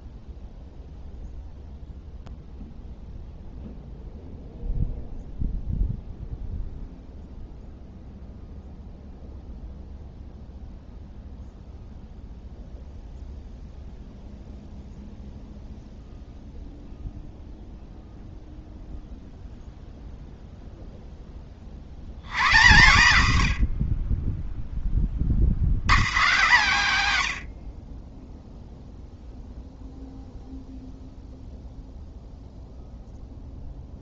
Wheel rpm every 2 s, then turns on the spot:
0, 0, 0, 0, 0, 0, 0, 0, 120, 0, 150, 0, 0, 0, 40, 50, 0.
30-32